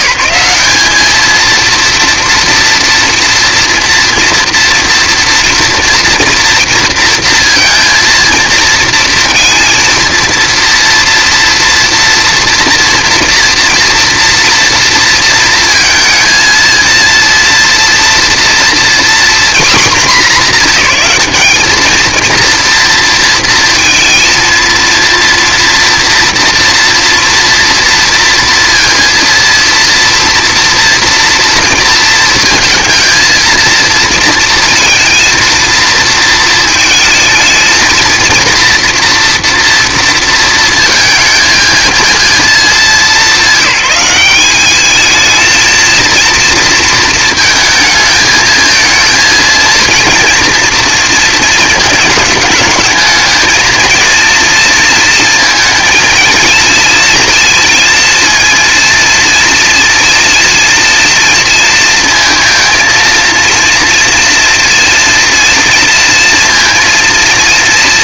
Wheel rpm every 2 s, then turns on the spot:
210, 230, 230, 230, 230, 230, 230, 230, 230, 240, 200, 230, 230, 230, 230, 230, 230, 230, 220, 240, 230, 190, 210, 230, 220, 230, 220, 230, 230, 230, 230, 230, 230, 230.
none